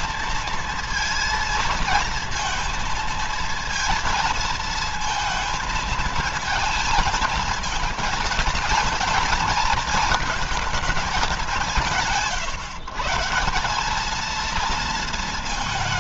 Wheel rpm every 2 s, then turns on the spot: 230, 220, 230, 230, 230, 220, 150, 220.
none